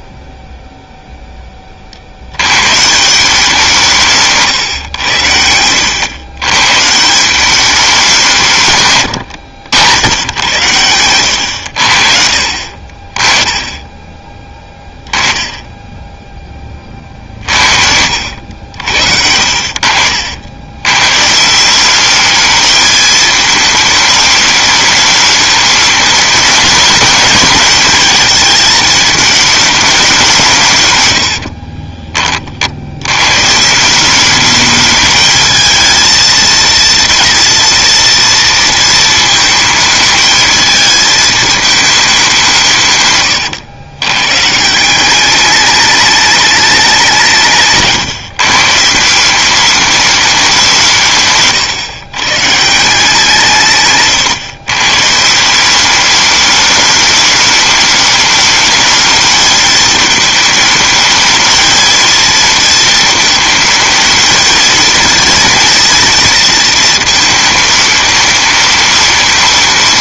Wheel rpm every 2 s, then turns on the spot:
0, 120, 130, 120, 160, 100, 50, 20, 20, 80, 100, 220, 210, 220, 220, 150, 60, 210, 230, 230, 220, 160, 150, 210, 150, 180, 140, 130, 210, 210, 220, 230, 230, 230, 210.
none